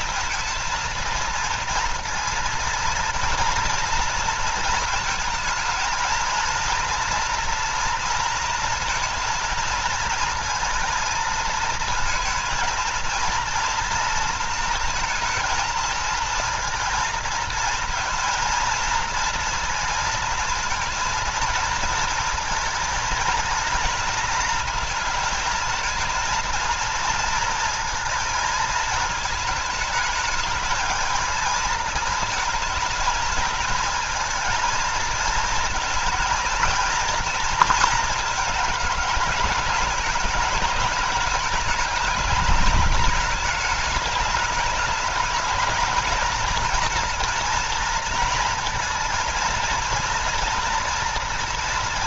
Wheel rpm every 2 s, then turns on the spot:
230, 230, 220, 230, 230, 230, 230, 220, 220, 230, 230, 230, 230, 230, 220, 220, 230, 230, 230, 220, 210, 210, 210, 230, 230, 240.
none